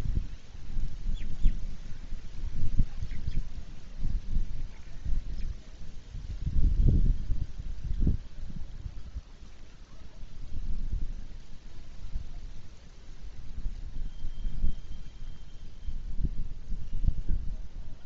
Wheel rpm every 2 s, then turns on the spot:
0, 0, 0, 0, 0, 0, 0, 0, 0.
none